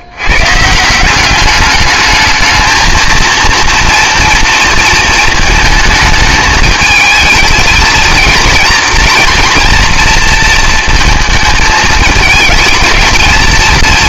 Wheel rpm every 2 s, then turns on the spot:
150, 220, 230, 220, 230, 230, 220.
none